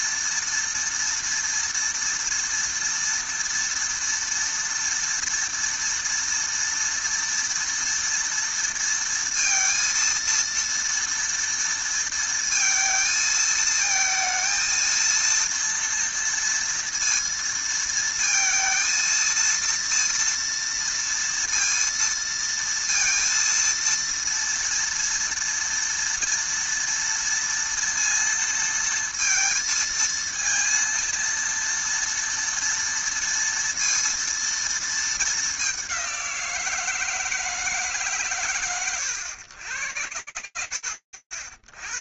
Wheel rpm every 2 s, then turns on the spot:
230, 230, 230, 230, 230, 230, 230, 230, 230, 230, 230, 230, 230, 240, 230, 230, 230, 230, 170, 110, 80.
none